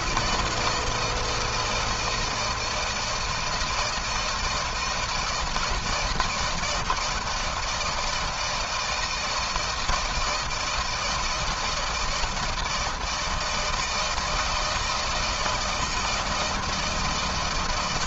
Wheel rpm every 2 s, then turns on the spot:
170, 170, 160, 160, 160, 160, 160, 160, 160.
none